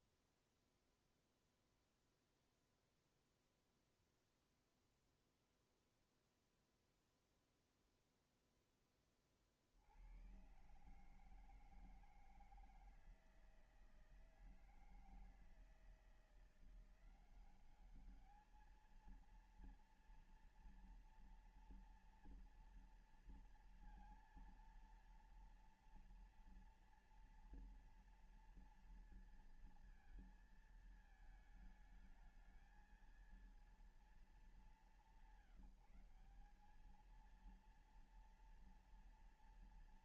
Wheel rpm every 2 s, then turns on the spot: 0, 0, 0, 0, 10, 130, 160, 160, 180, 220, 230, 230, 230, 230, 230, 220, 220, 200, 210, 240.
none